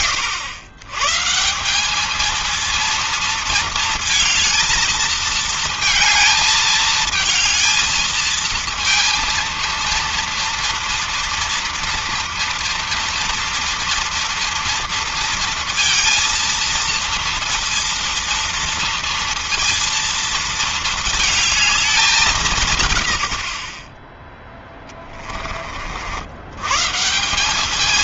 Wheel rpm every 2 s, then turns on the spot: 120, 220, 220, 220, 220, 230, 230, 230, 230, 230, 230, 170, 10, 110.
24-26